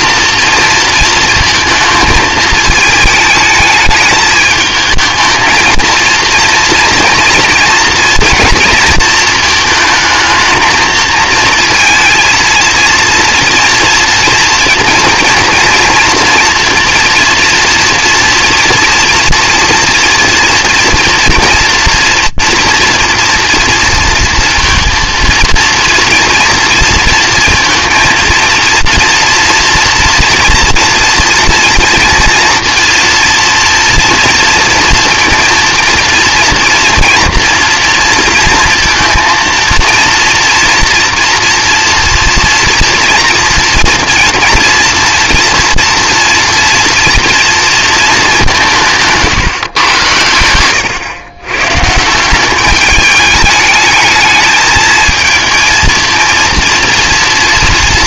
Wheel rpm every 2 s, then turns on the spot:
230, 220, 220, 230, 230, 220, 230, 230, 230, 240, 230, 230, 230, 230, 230, 230, 230, 230, 230, 230, 230, 230, 240, 230, 170, 100, 200, 220, 230.
none